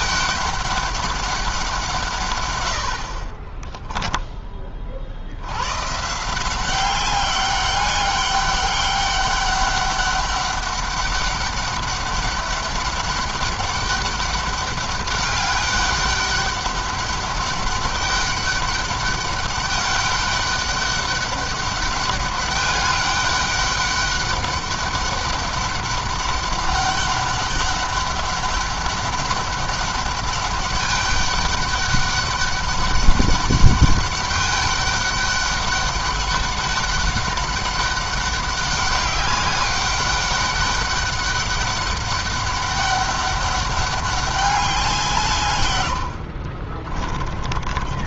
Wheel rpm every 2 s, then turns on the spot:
200, 90, 40, 190, 200, 200, 200, 200, 200, 200, 200, 200, 200, 200, 200, 200, 200, 200, 200, 200, 190, 200, 190, 60.
46-48